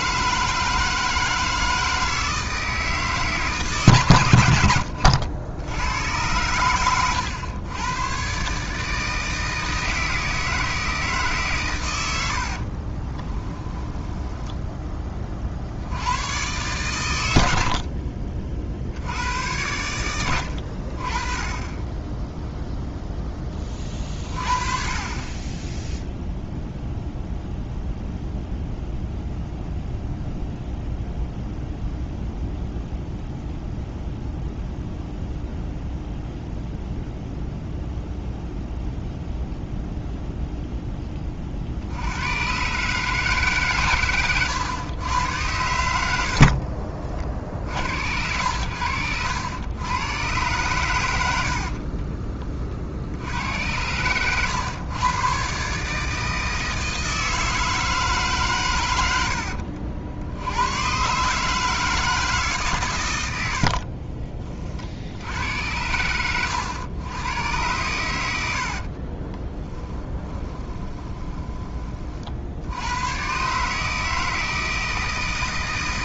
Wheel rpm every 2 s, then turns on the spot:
160, 160, 90, 100, 140, 160, 60, 10, 120, 60, 70, 0, 40, 0, 0, 0, 0, 0, 0, 0, 0, 130, 110, 50, 90, 120, 50, 120, 160, 120, 100, 150, 40, 100, 70, 20, 70, 160.
12-14 46-48 68-72